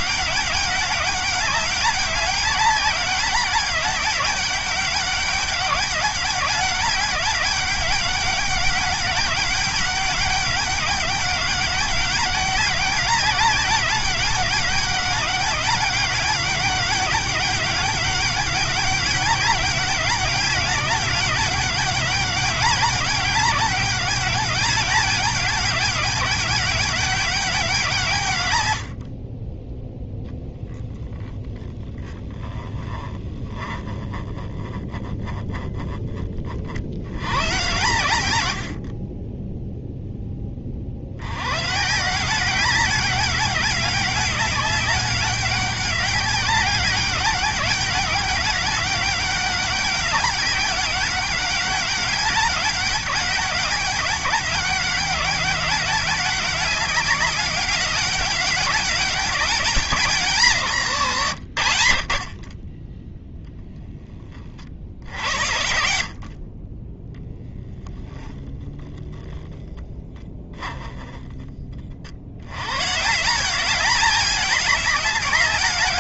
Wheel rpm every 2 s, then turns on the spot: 200, 200, 200, 200, 200, 190, 200, 200, 200, 200, 200, 200, 210, 190, 70, 0, 10, 20, 60, 60, 50, 190, 200, 200, 200, 200, 200, 200, 200, 200, 160, 20, 50, 20, 0, 10, 120, 210.
28-30 32-36